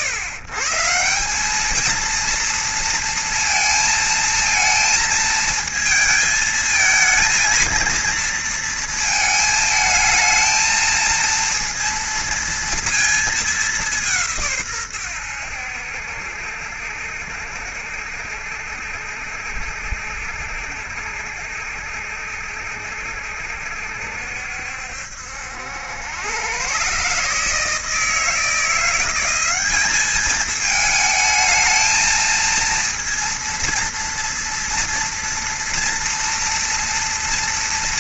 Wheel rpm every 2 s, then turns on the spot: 140, 230, 220, 220, 230, 220, 230, 140, 70, 70, 70, 70, 70, 120, 170, 220, 230, 230, 240.
none